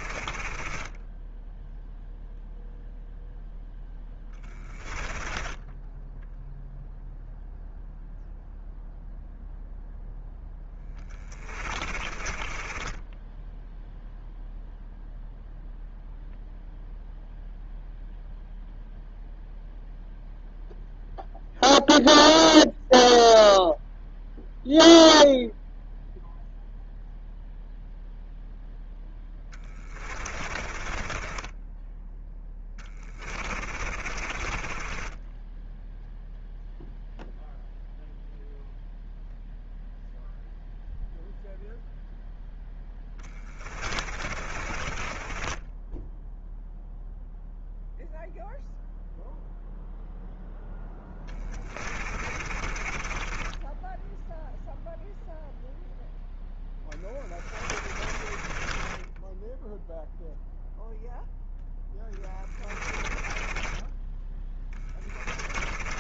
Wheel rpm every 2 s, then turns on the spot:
20, 0, 20, 0, 0, 20, 20, 0, 0, 0, 0, 0, 0, 0, 0, 30, 10, 30, 0, 0, 0, 10, 30, 0, 0, 0, 30, 0, 10, 20, 0, 20, 20.
0-2 4-6 10-14 30-36 42-46 52-54 58-60 62-66